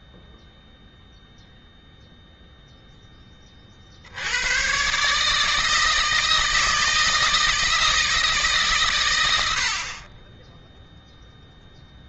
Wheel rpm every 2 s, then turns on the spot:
0, 0, 100, 160, 140, 10.
none